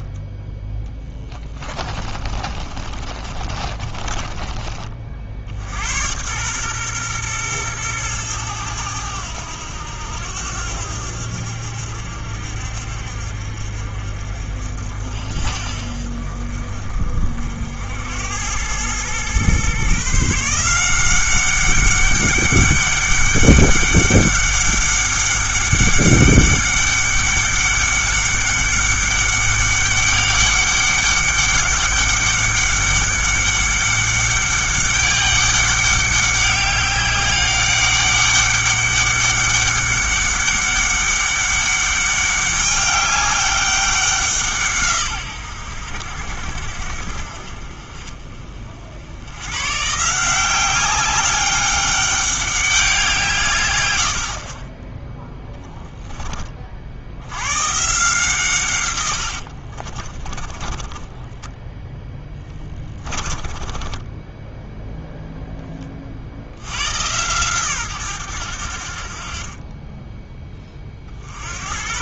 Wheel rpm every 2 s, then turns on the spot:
10, 30, 30, 120, 100, 80, 60, 60, 50, 100, 170, 200, 200, 200, 200, 200, 200, 200, 200, 200, 200, 200, 160, 60, 40, 190, 200, 30, 40, 130, 20, 30, 10, 90, 80, 30.
0-4 60-64